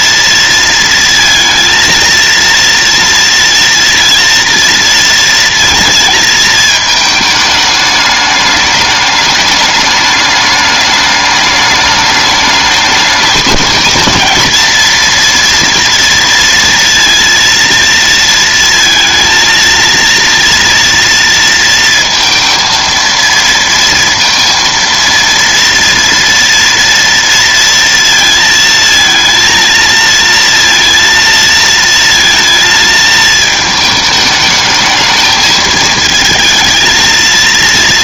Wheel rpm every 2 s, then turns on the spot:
230, 230, 230, 220, 210, 210, 210, 230, 230, 230, 230, 230, 230, 230, 230, 230, 220, 220, 220.
none